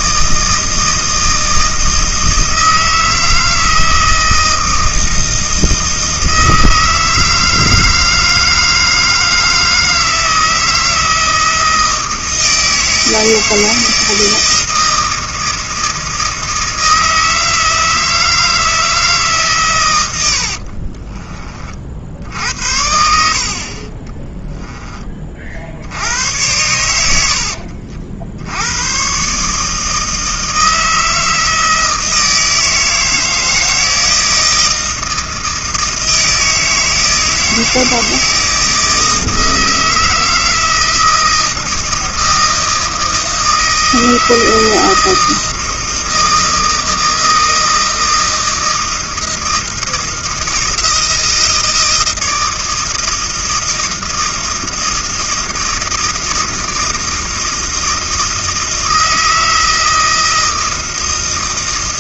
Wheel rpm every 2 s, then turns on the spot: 160, 160, 160, 160, 160, 160, 160, 160, 160, 160, 60, 80, 10, 100, 90, 160, 160, 160, 160, 160, 160, 160, 160, 160, 160, 160, 160, 160, 160, 160, 160.
20-22